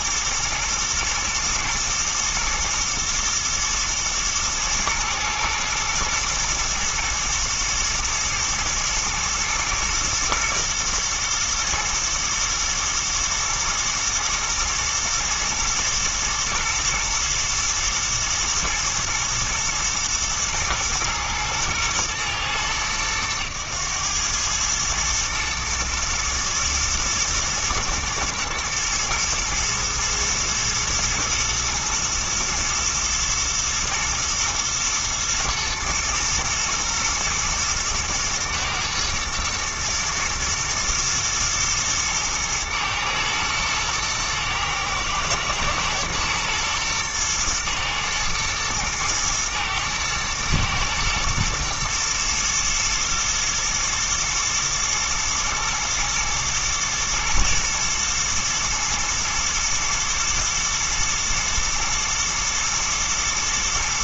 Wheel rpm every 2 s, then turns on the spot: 110, 120, 120, 110, 110, 120, 120, 110, 110, 120, 120, 110, 110, 110, 110, 110, 110, 120, 110, 110, 110, 110, 110, 120, 110, 110, 110, 120, 110, 110, 110, 110.
none